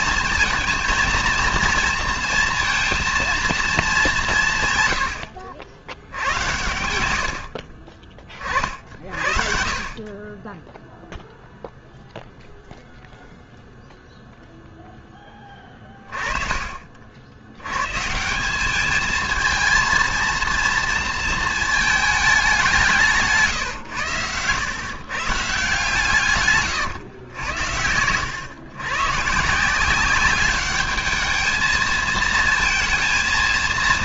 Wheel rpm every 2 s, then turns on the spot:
220, 230, 120, 90, 50, 0, 0, 10, 50, 220, 230, 160, 120, 120, 130, 210, 230.
none